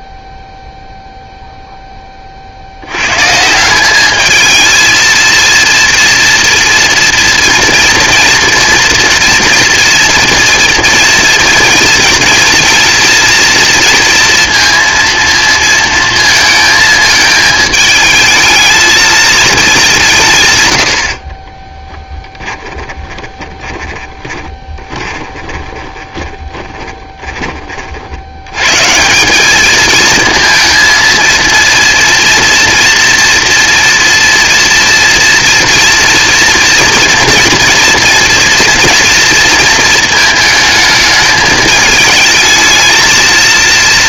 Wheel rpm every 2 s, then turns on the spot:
0, 70, 220, 230, 240, 230, 220, 230, 220, 220, 110, 10, 20, 30, 110, 230, 230, 240, 230, 230, 220, 220.
22-28